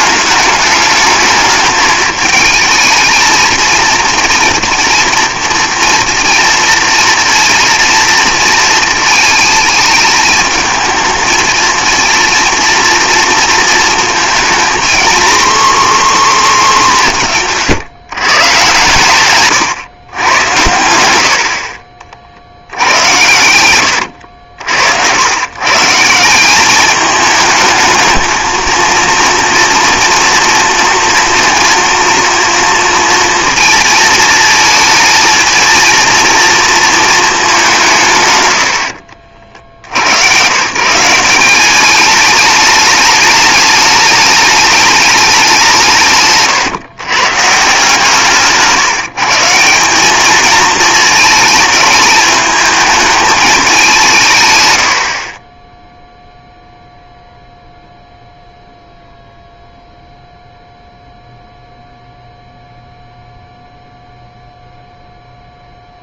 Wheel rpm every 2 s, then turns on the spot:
210, 220, 230, 230, 220, 220, 230, 230, 240, 130, 110, 70, 70, 180, 220, 230, 230, 220, 230, 110, 120, 210, 210, 140, 140, 220, 210, 140, 0, 0, 0, 0, 0.
24-26